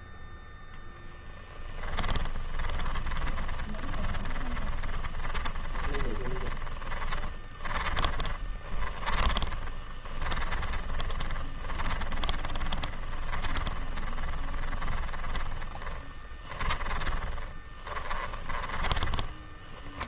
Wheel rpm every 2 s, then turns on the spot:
0, 20, 20, 20, 20, 20, 20, 20, 20, 20.
2-20